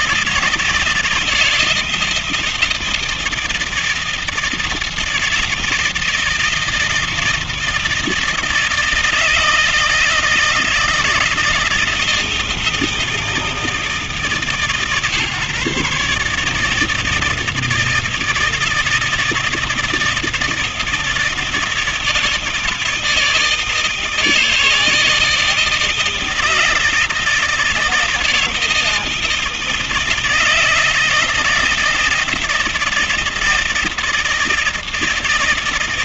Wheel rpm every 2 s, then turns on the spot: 160, 160, 160, 160, 160, 160, 170, 150, 160, 160, 160, 160, 160, 160, 160, 160, 160, 160.
none